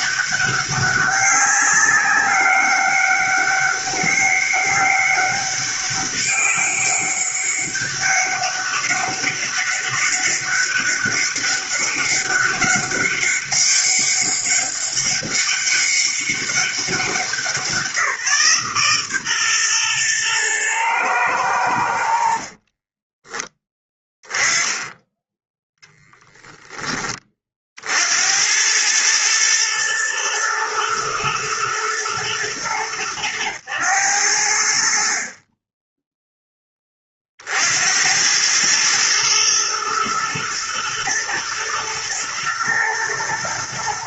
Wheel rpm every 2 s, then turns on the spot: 200, 200, 200, 200, 200, 200, 200, 200, 190, 140, 110, 30, 10, 10, 100, 110, 100, 60, 20, 110, 110, 120.
22-24